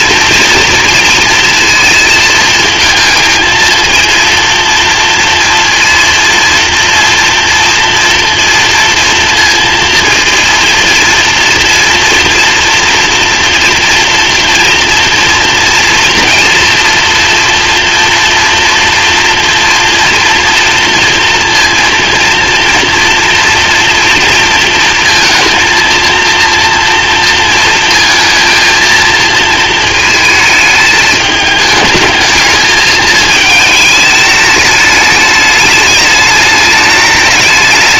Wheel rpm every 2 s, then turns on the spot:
230, 220, 230, 230, 230, 230, 230, 240, 230, 240, 230, 230, 230, 230, 230, 220, 220, 220, 210.
none